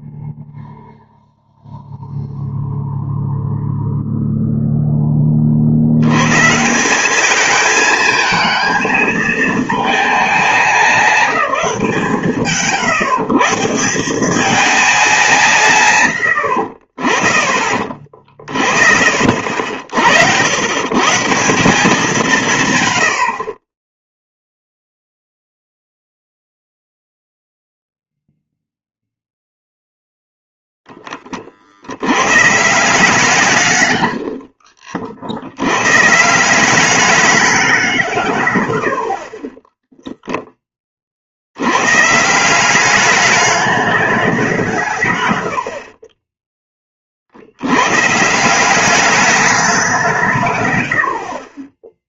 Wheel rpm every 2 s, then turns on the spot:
0, 0, 10, 170, 220, 210, 140, 200, 50, 50, 120, 90, 0, 0, 0, 10, 160, 50, 190, 80, 30, 190, 160, 20, 190, 110.
none